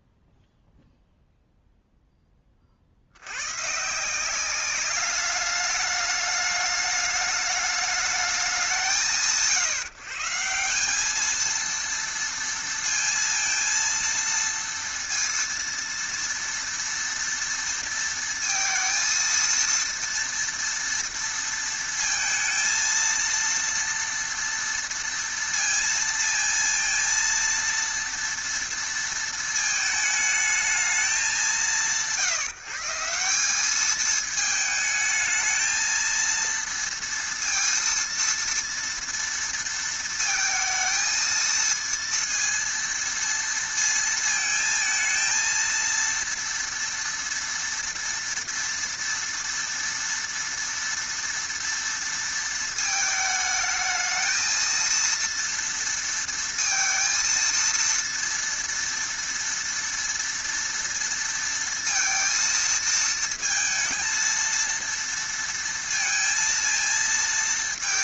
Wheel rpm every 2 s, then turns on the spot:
0, 40, 200, 210, 170, 180, 230, 230, 230, 230, 230, 230, 230, 230, 230, 220, 160, 220, 230, 230, 220, 230, 220, 230, 230, 230, 230, 230, 230, 230, 230, 230, 230, 230.
none